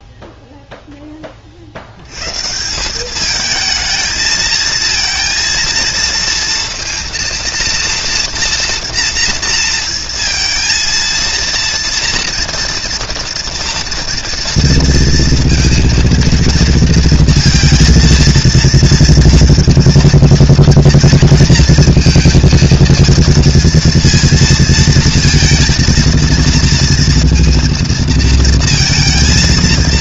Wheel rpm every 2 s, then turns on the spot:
0, 130, 220, 230, 230, 230, 230, 230, 230, 230, 230, 230, 230, 230, 230.
none